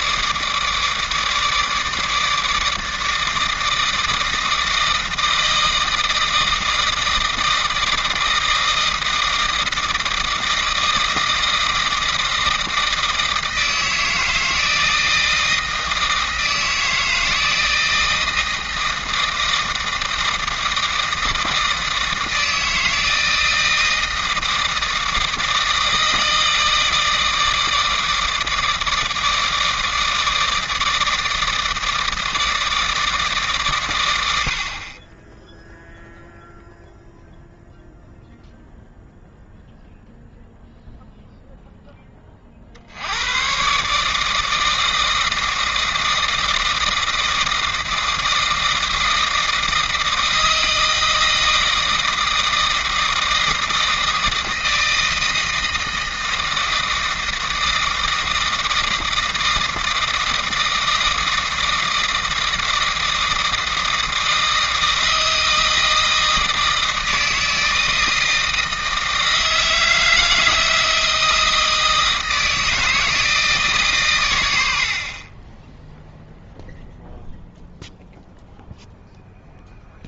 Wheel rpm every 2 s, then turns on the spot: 150, 160, 160, 160, 160, 160, 160, 160, 160, 160, 160, 160, 160, 160, 160, 160, 160, 50, 0, 0, 0, 50, 160, 160, 160, 160, 160, 160, 160, 160, 160, 160, 160, 160, 160, 160, 160, 80, 0, 0.
none